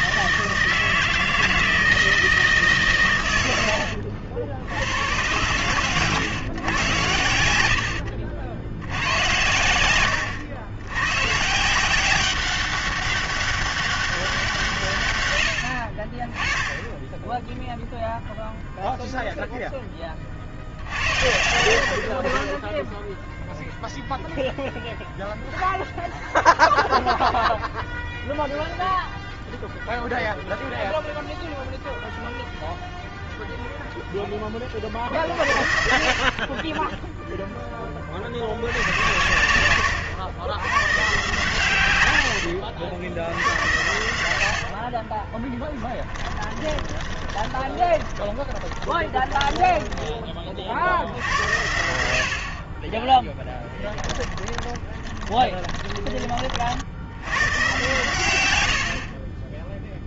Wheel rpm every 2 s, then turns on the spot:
160, 160, 70, 120, 80, 90, 190, 180, 10, 0, 60, 20, 0, 0, 0, 0, 0, 20, 30, 80, 120, 70, 80, 20, 20, 50, 40, 20, 50, 90.
42-44 46-50 54-56 58-60